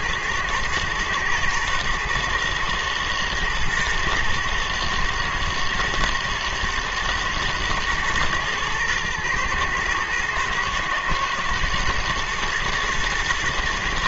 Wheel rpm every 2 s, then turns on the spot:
110, 110, 120, 120, 110, 120, 110.
none